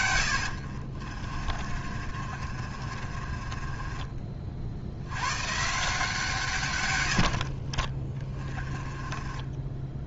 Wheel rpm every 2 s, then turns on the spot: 60, 40, 70, 120, 20.
none